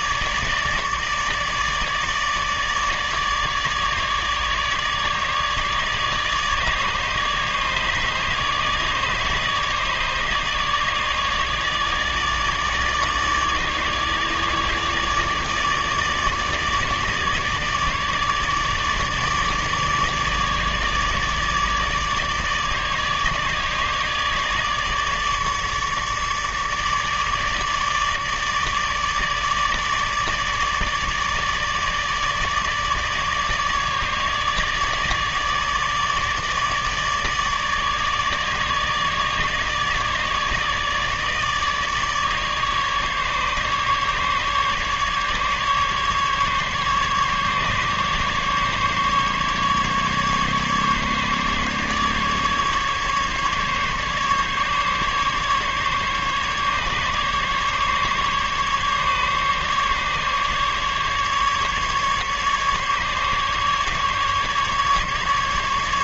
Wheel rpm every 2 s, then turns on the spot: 150, 150, 150, 150, 150, 150, 150, 150, 160, 150, 150, 150, 150, 150, 150, 150, 150, 150, 150, 150, 150, 150, 150, 140, 140, 140, 140, 140, 150, 150, 150, 150, 150.
none